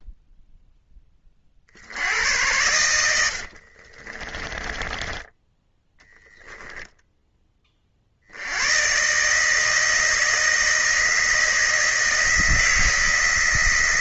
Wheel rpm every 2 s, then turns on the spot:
0, 100, 20, 20, 100, 160, 160.
2-8